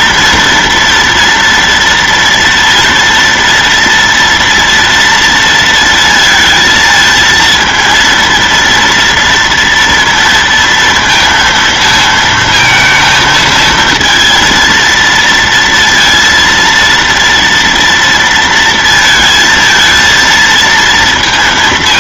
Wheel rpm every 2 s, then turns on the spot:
240, 230, 230, 230, 230, 230, 220, 230, 230, 230, 230.
none